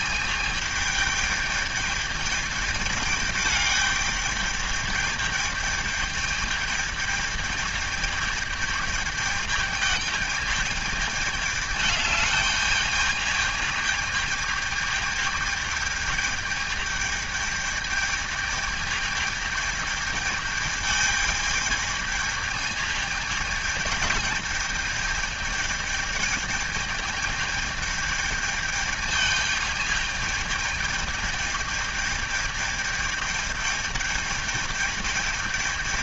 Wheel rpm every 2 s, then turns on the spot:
210, 210, 220, 210, 210, 210, 210, 210, 210, 210, 210, 210, 220, 210, 220, 220, 210, 210.
none